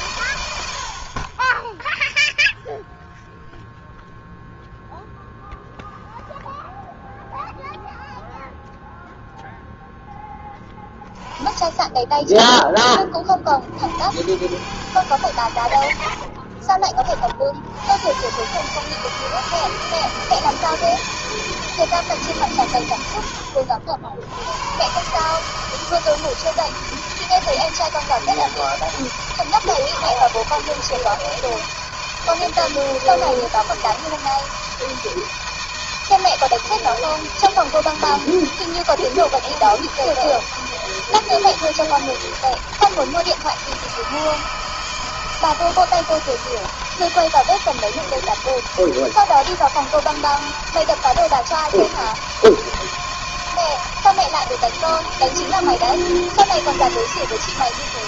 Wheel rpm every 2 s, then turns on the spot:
80, 0, 0, 0, 0, 10, 20, 100, 50, 140, 160, 110, 110, 160, 160, 160, 160, 160, 160, 160, 160, 160, 160, 160, 160, 160, 160, 160, 160.
16-18